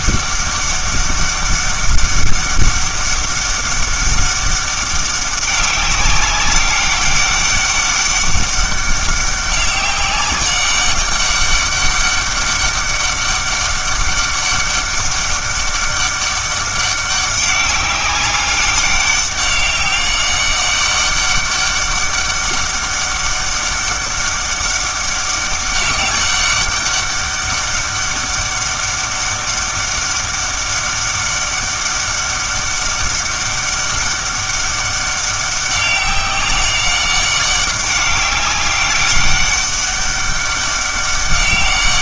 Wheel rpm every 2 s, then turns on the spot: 200, 200, 200, 200, 200, 200, 200, 200, 200, 200, 200, 200, 200, 200, 200, 200, 200, 200, 190, 200, 200.
none